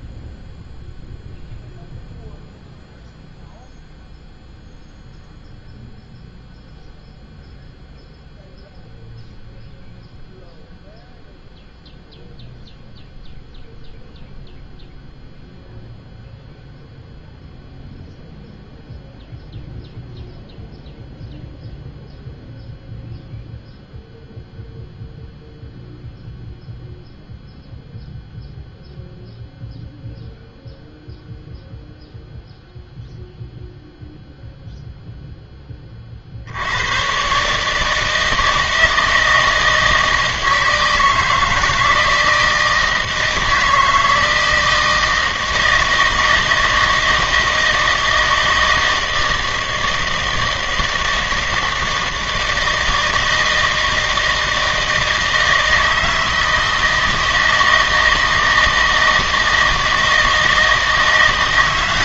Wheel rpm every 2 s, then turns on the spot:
0, 0, 0, 0, 0, 0, 0, 0, 0, 0, 0, 0, 0, 0, 0, 0, 0, 0, 90, 160, 160, 160, 160, 160, 160, 160, 160, 160, 160, 160, 160.
none